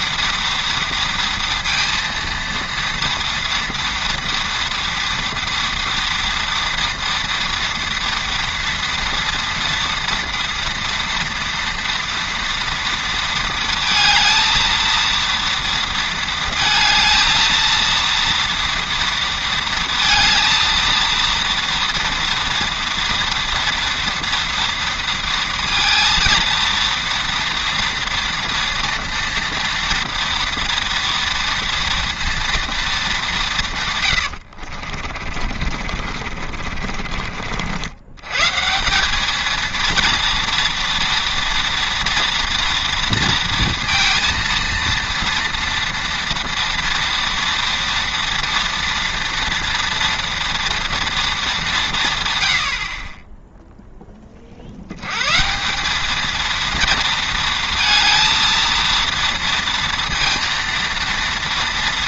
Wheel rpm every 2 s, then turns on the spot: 230, 230, 230, 230, 230, 230, 230, 230, 220, 230, 230, 230, 230, 230, 230, 230, 230, 60, 40, 170, 230, 230, 230, 230, 230, 230, 70, 70, 230, 230, 230.
34-38